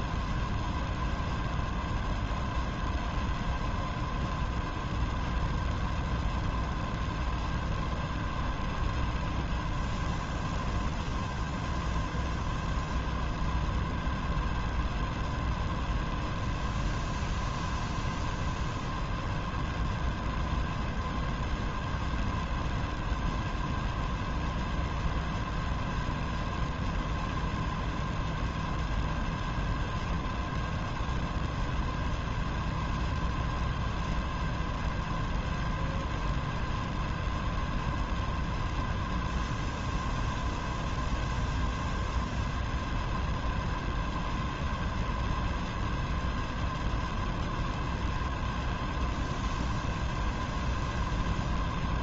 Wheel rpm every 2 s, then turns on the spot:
0, 0, 0, 0, 0, 0, 0, 0, 0, 0, 0, 0, 0, 0, 0, 0, 0, 0, 0, 0, 0, 0, 0, 0, 0, 0.
none